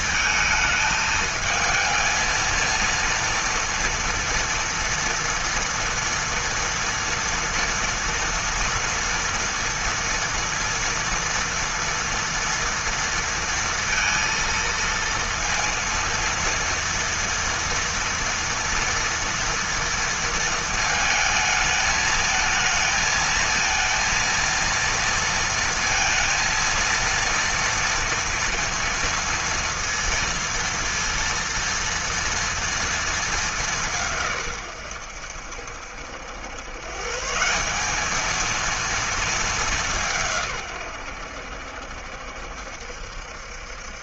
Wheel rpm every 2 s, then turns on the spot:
220, 230, 230, 230, 230, 230, 230, 230, 230, 230, 220, 220, 230, 230, 230, 230, 230, 120, 120, 230, 130, 70.
none